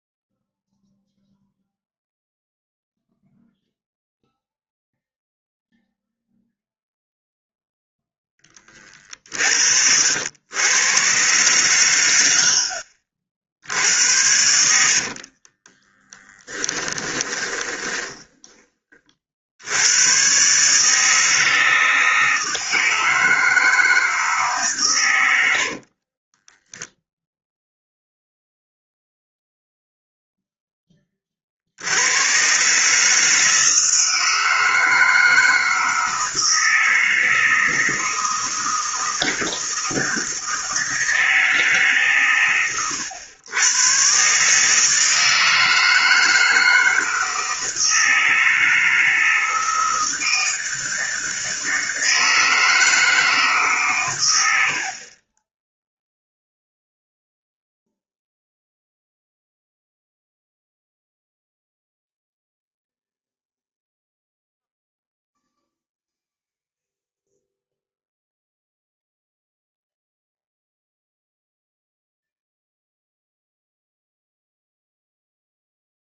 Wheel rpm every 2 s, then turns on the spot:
0, 0, 0, 0, 30, 100, 60, 70, 20, 20, 140, 160, 140, 10, 0, 10, 120, 160, 160, 160, 160, 110, 150, 160, 160, 160, 160, 80, 0, 0, 0, 0, 0, 0, 0, 0, 0, 0.
14-18 26-28